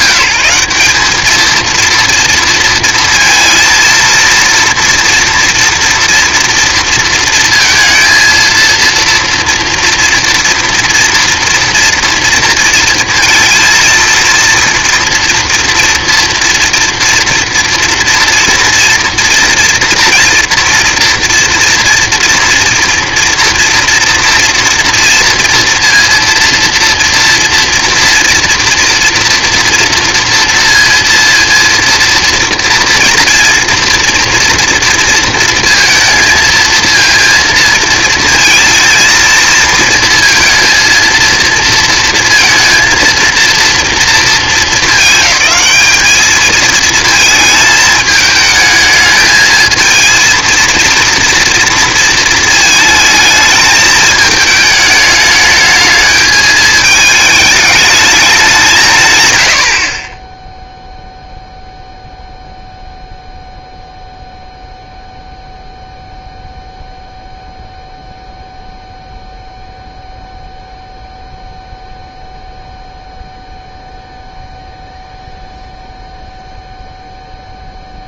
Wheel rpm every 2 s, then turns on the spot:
200, 230, 240, 230, 230, 230, 230, 230, 230, 230, 230, 230, 230, 230, 230, 230, 230, 230, 230, 230, 230, 230, 210, 220, 220, 230, 220, 210, 220, 150, 0, 0, 0, 0, 0, 0, 0, 0, 0.
none